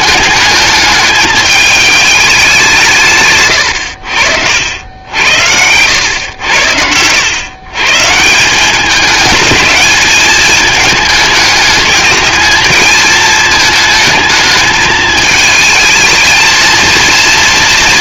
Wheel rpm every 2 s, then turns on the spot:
220, 170, 80, 90, 170, 210, 220, 220, 220.
none